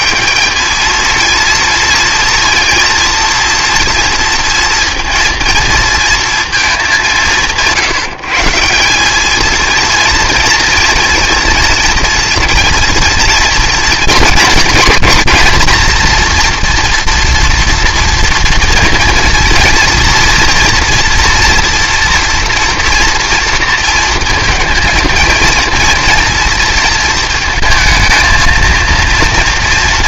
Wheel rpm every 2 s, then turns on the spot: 210, 230, 230, 220, 180, 230, 230, 230, 230, 230, 240, 230, 230, 230, 230.
none